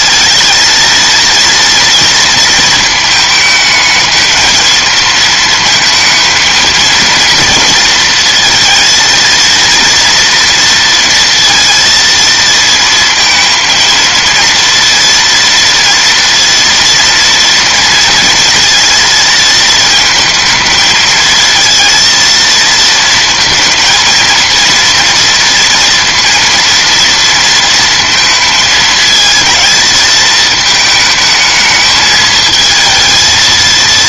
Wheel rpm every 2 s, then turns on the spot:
230, 230, 220, 230, 230, 230, 230, 230, 230, 230, 220, 220, 230, 230, 220, 220, 220.
none